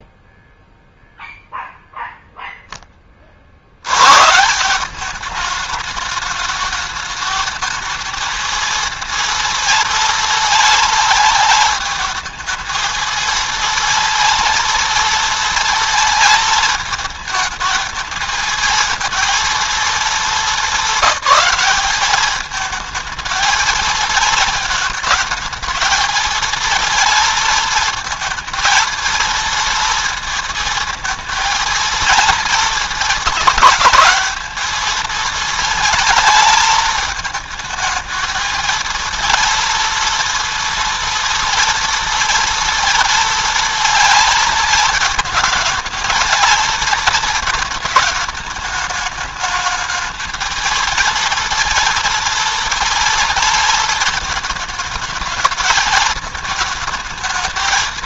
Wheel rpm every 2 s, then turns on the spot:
0, 20, 190, 210, 220, 220, 220, 230, 220, 220, 200, 220, 220, 230, 230, 220, 220, 220, 220, 230, 230, 230, 220, 220, 210, 230, 230, 220, 220.
none